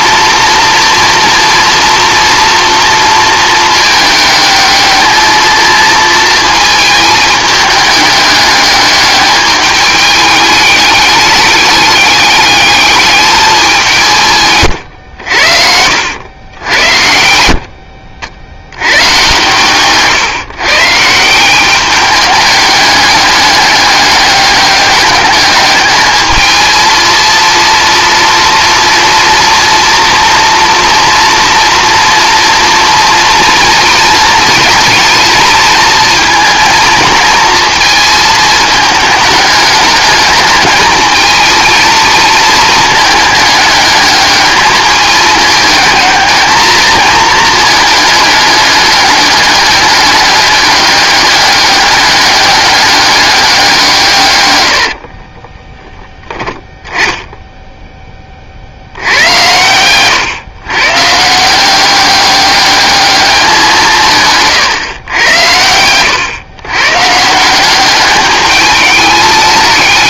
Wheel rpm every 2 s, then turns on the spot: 240, 230, 210, 220, 210, 210, 210, 120, 90, 90, 140, 210, 200, 230, 230, 230, 230, 230, 230, 210, 220, 220, 210, 220, 200, 200, 200, 100, 10, 70, 130, 200, 130, 120, 210.
none